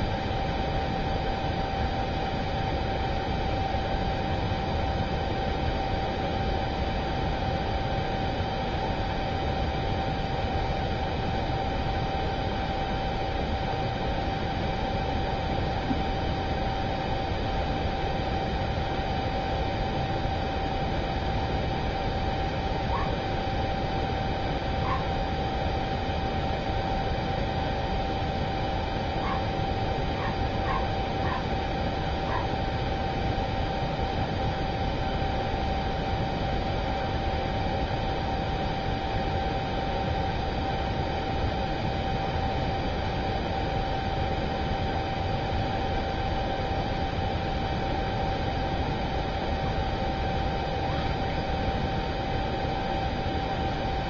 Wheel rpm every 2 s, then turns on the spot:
0, 0, 0, 0, 0, 0, 0, 0, 0, 0, 0, 0, 0, 0, 0, 0, 0, 0, 0, 0, 0, 0, 0, 0, 0, 0, 0.
none